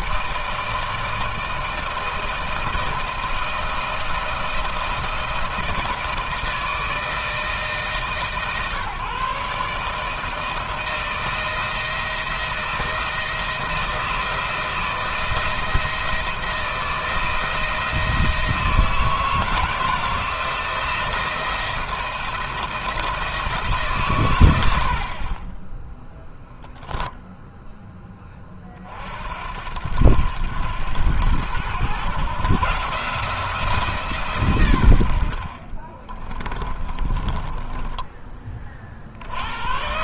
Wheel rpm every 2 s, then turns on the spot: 160, 160, 170, 160, 150, 160, 170, 160, 160, 160, 170, 170, 100, 10, 30, 100, 140, 120, 20, 30.
36-38